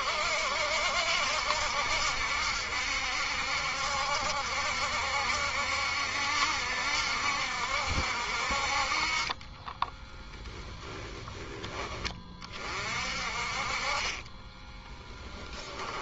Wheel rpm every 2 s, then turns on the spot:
70, 70, 70, 70, 50, 10, 40, 20.
14-16